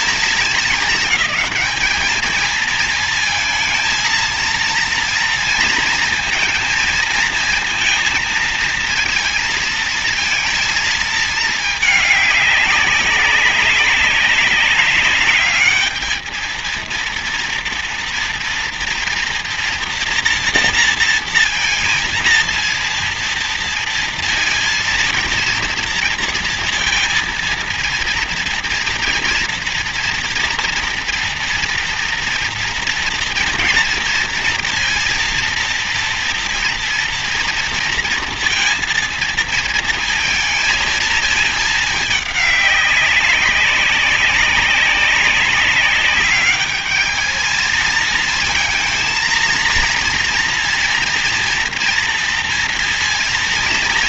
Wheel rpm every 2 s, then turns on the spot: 220, 220, 230, 230, 230, 230, 210, 200, 220, 230, 230, 230, 230, 230, 230, 230, 230, 230, 230, 230, 230, 210, 200, 200, 220, 230, 230.
none